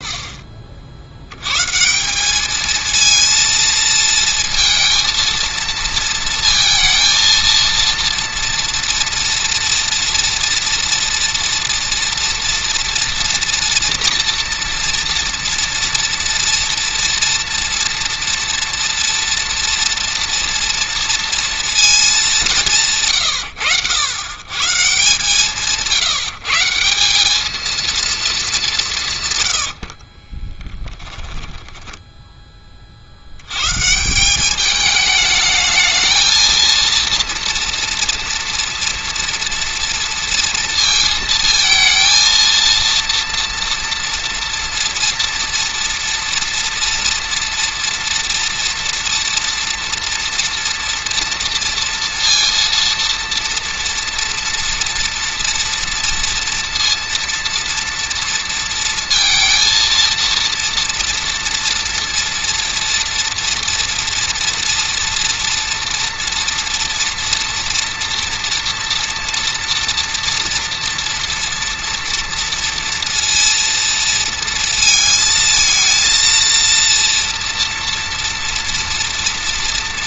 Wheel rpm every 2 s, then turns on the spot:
40, 220, 230, 230, 230, 230, 230, 240, 240, 230, 230, 170, 140, 170, 180, 10, 30, 210, 230, 230, 230, 230, 230, 240, 230, 230, 230, 230, 230, 230, 240, 230, 230, 230, 230, 230, 230, 220, 230, 230.
30-32